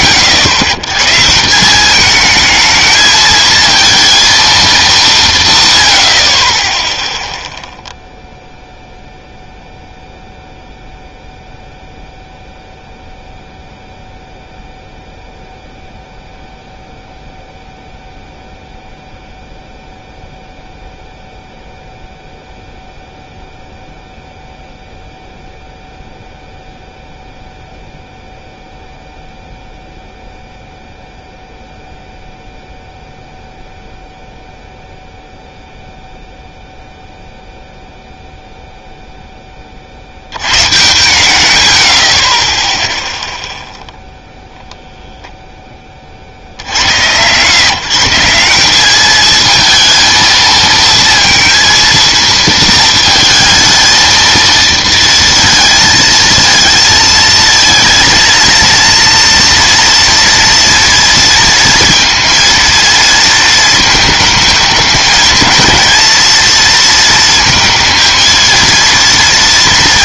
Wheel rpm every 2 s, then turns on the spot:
120, 220, 220, 20, 0, 0, 0, 0, 0, 0, 0, 0, 0, 0, 0, 0, 0, 0, 0, 0, 110, 20, 0, 110, 200, 230, 230, 230, 220, 230, 230, 230, 210, 230, 230.
none